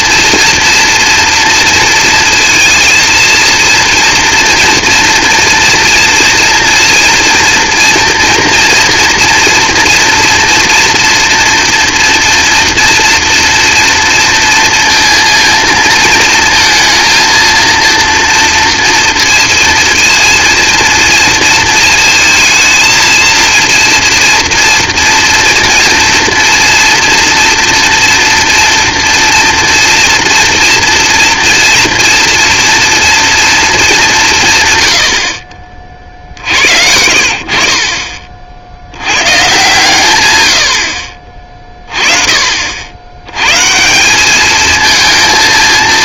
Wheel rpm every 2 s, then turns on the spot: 240, 230, 230, 230, 230, 230, 230, 230, 230, 230, 230, 220, 240, 230, 230, 230, 230, 130, 60, 50, 80, 60, 220.
34-36